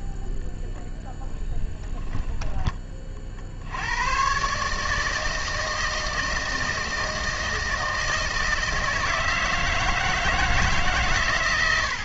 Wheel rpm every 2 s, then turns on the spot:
0, 10, 140, 160, 160, 160.
none